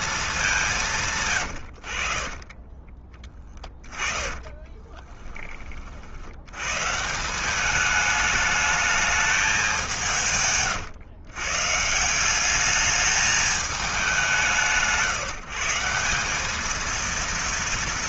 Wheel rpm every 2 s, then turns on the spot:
170, 30, 30, 140, 210, 120, 210, 150, 220.
2-6